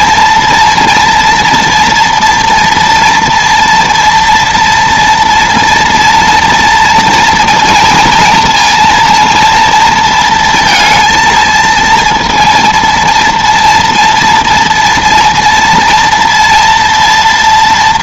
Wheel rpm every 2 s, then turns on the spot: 230, 230, 230, 230, 220, 230, 230, 230, 230.
none